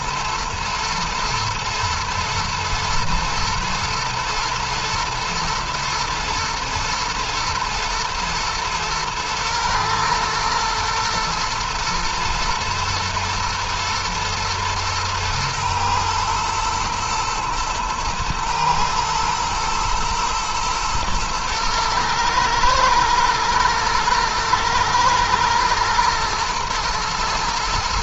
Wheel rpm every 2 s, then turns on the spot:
110, 110, 120, 120, 110, 110, 110, 110, 120, 120, 120, 110, 120, 110.
none